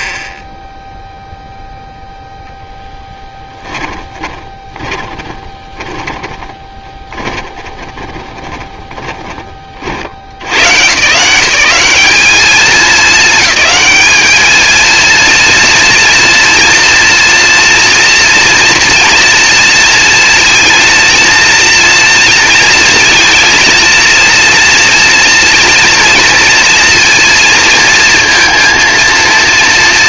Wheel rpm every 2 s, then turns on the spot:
0, 0, 20, 20, 30, 100, 220, 220, 230, 240, 230, 230, 240, 230, 230.
4-10